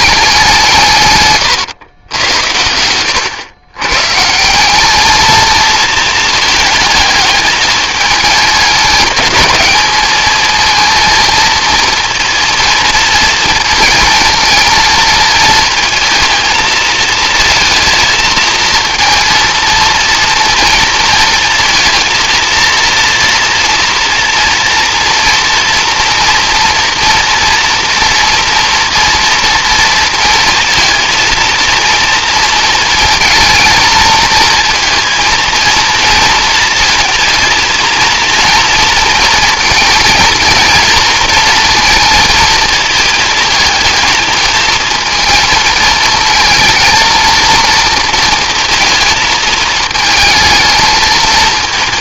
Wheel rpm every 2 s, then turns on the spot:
150, 90, 210, 220, 210, 230, 230, 220, 220, 230, 230, 230, 230, 230, 230, 230, 230, 230, 230, 230, 230, 220, 220, 230, 230, 220.
none